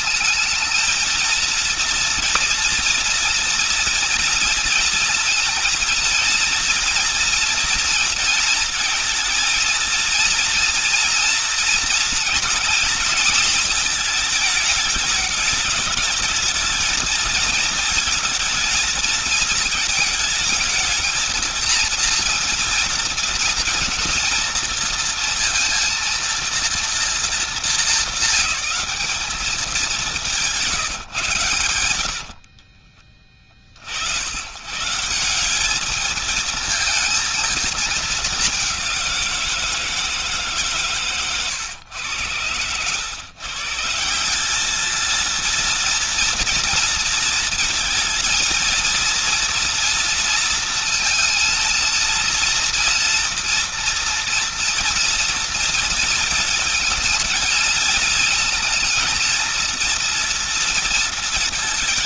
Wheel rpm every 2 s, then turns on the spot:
220, 240, 230, 230, 230, 230, 230, 220, 210, 230, 220, 230, 230, 230, 220, 170, 20, 100, 220, 200, 150, 110, 200, 230, 230, 230, 230, 230, 230, 220, 230.
32-34